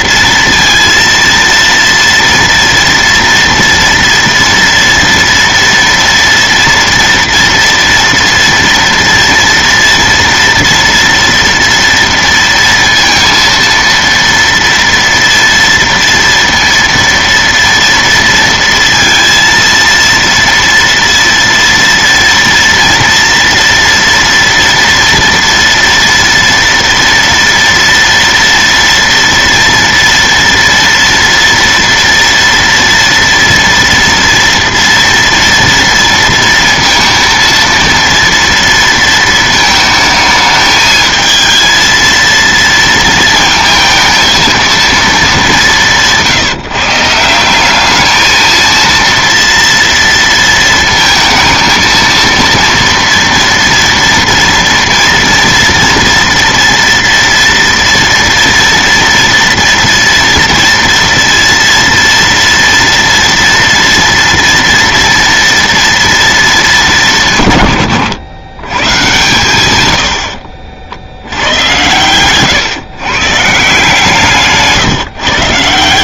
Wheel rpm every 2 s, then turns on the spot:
230, 230, 230, 230, 230, 230, 230, 230, 230, 230, 230, 240, 230, 230, 230, 230, 230, 230, 230, 230, 220, 230, 220, 150, 230, 230, 230, 230, 230, 230, 230, 230, 230, 160, 120, 70, 130, 150.
none